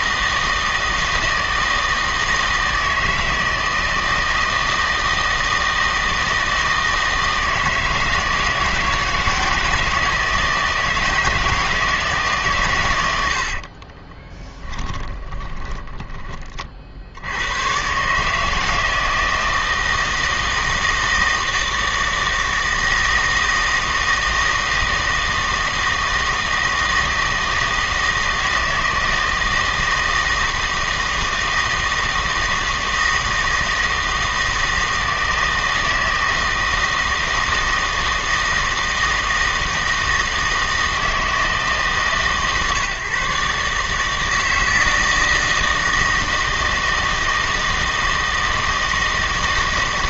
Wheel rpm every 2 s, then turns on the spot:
160, 160, 160, 160, 160, 160, 130, 10, 30, 160, 160, 160, 160, 160, 160, 160, 160, 160, 160, 160, 160, 140, 160, 160, 160.
14-16